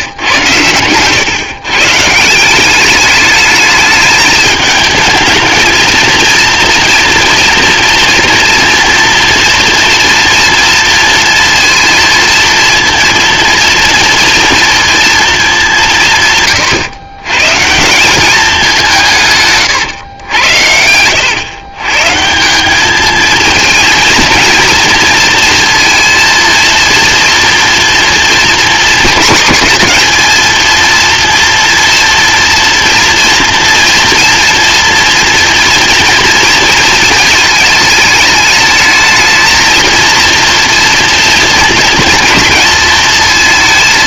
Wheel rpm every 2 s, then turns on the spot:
120, 200, 220, 230, 240, 230, 230, 230, 130, 170, 90, 210, 230, 230, 220, 230, 230, 240, 230, 220, 230, 230.
none